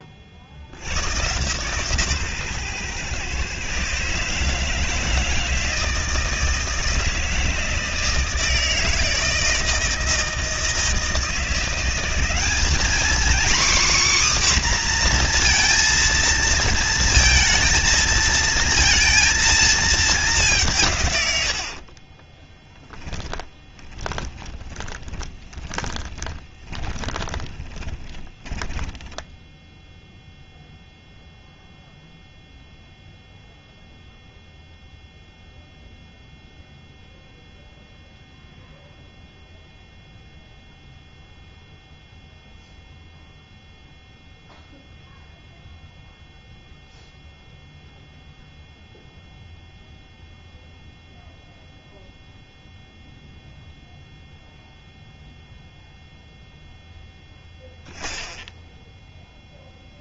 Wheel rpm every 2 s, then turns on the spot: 100, 130, 160, 170, 160, 160, 220, 260, 230, 220, 170, 10, 20, 20, 10, 0, 0, 0, 0, 0, 0, 0, 0, 0, 0, 0, 0, 0, 0, 0.
22-30